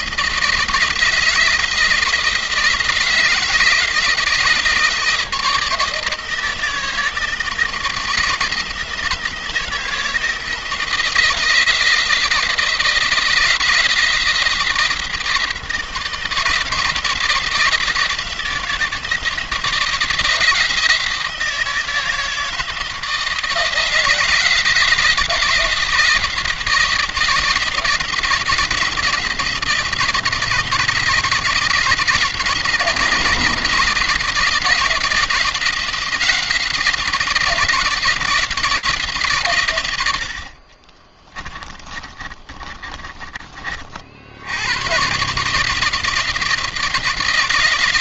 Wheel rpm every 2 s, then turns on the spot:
160, 170, 170, 160, 160, 170, 160, 160, 170, 160, 160, 160, 160, 160, 160, 160, 170, 170, 170, 160, 60, 30, 110, 170.
40-44